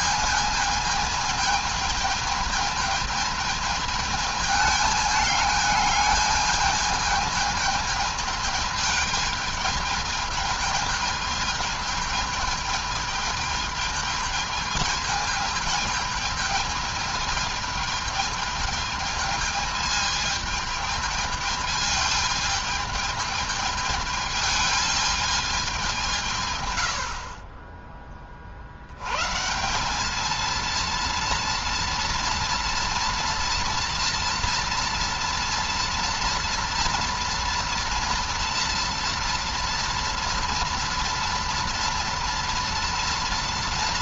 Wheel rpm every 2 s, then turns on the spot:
220, 220, 220, 220, 220, 220, 220, 220, 220, 220, 220, 220, 210, 110, 70, 230, 230, 230, 230, 230, 230, 230.
none